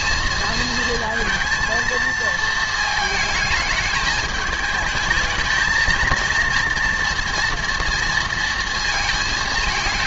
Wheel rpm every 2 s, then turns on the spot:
220, 220, 210, 230, 230.
none